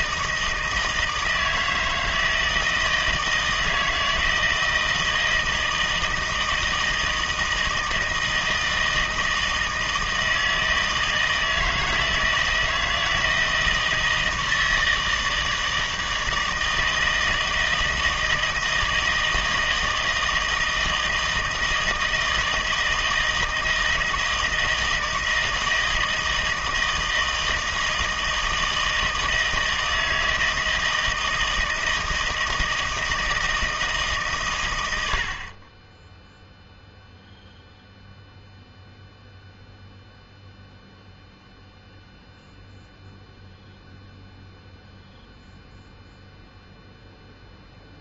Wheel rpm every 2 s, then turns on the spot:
160, 160, 160, 160, 160, 160, 160, 160, 160, 160, 160, 160, 160, 160, 160, 160, 160, 100, 0, 0, 0, 0, 0, 0.
none